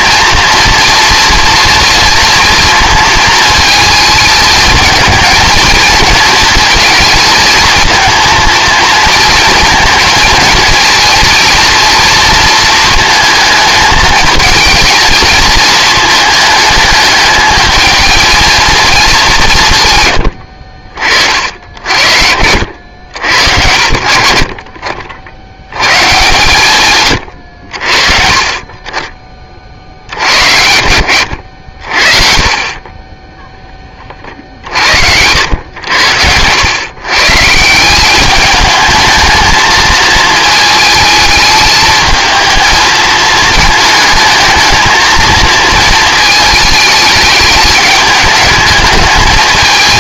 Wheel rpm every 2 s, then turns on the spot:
230, 230, 220, 230, 220, 220, 220, 220, 210, 230, 70, 80, 50, 120, 40, 80, 30, 60, 100, 210, 220, 220, 220, 220, 210.
20-22